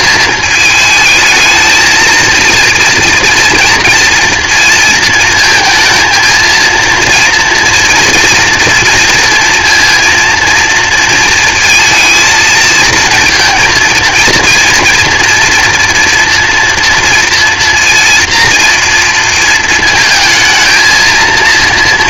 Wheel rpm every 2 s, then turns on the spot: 220, 230, 230, 230, 230, 230, 230, 230, 240, 230, 220.
none